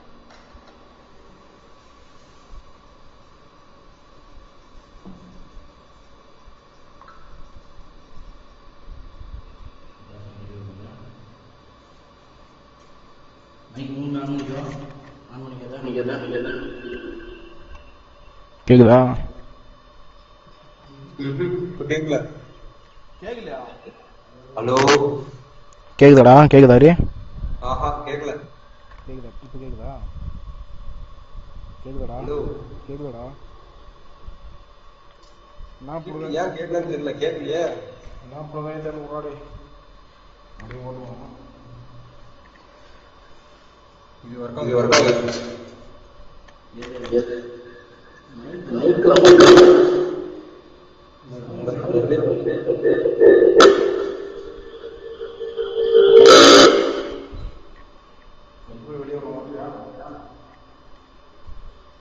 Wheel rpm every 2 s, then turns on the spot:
0, 0, 0, 0, 0, 0, 0, 0, 0, 0, 0, 0, 0, 0, 0, 0, 0, 0, 0, 0, 0, 0, 0, 0, 0, 0, 0, 0, 0, 0, 0.
none